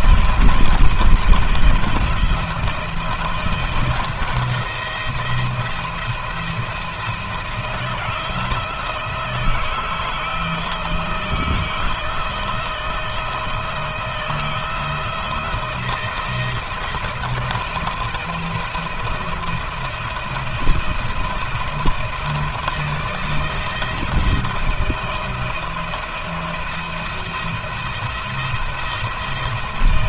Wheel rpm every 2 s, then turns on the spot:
170, 170, 170, 170, 170, 160, 160, 160, 170, 170, 170, 170, 170, 170, 170.
none